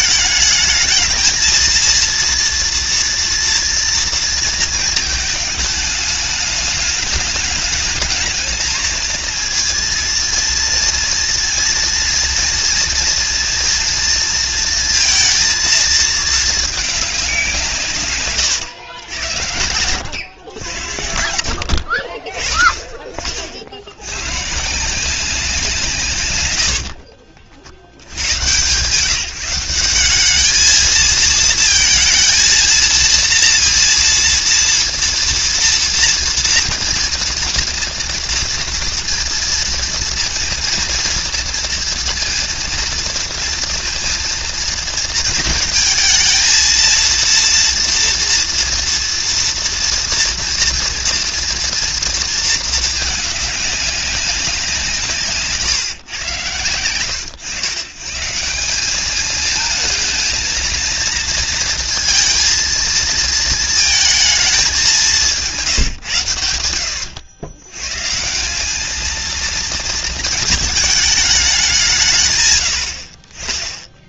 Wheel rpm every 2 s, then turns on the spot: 220, 230, 220, 210, 220, 230, 230, 230, 200, 110, 80, 50, 160, 60, 140, 220, 230, 230, 230, 230, 230, 230, 230, 230, 230, 230, 210, 170, 90, 190, 230, 220, 200, 90, 220, 210, 60.
26-28